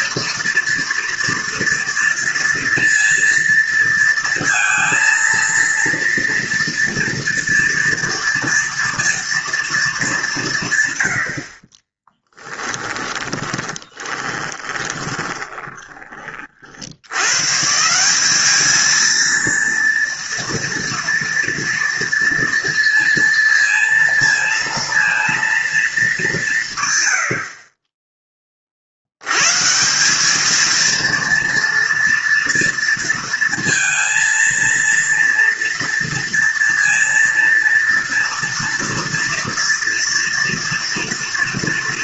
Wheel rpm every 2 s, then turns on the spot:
230, 230, 230, 240, 240, 130, 20, 20, 80, 220, 230, 230, 230, 130, 60, 230, 230, 230, 230, 230, 230.
12-16